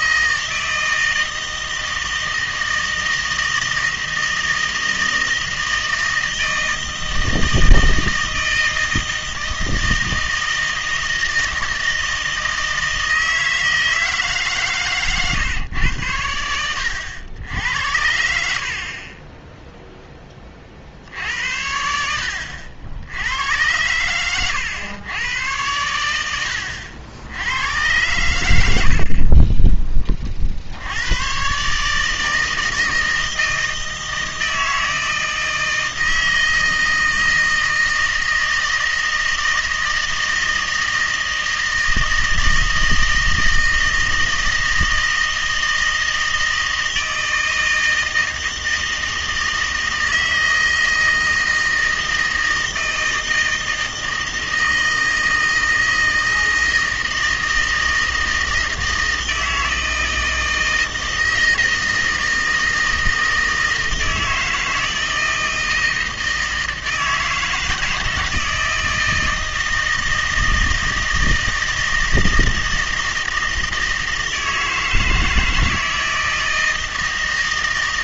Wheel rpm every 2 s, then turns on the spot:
160, 160, 160, 160, 160, 160, 160, 150, 100, 50, 50, 70, 110, 90, 80, 70, 160, 160, 160, 160, 160, 160, 160, 160, 160, 160, 160, 160, 160, 160, 160, 160, 160, 160, 160, 160, 160, 160, 160.
none